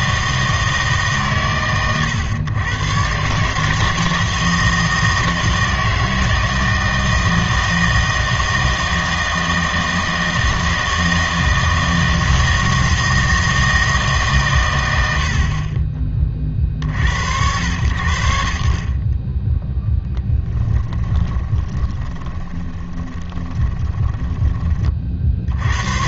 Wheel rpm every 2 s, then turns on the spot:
160, 110, 160, 160, 160, 160, 160, 120, 40, 70, 10, 20, 20.
20-24